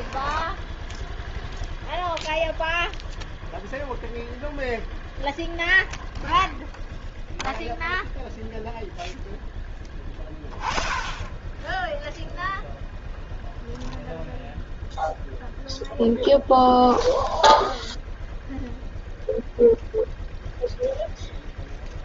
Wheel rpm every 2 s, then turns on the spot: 10, 0, 0, 0, 0, 10, 0, 0, 0, 0, 0.
none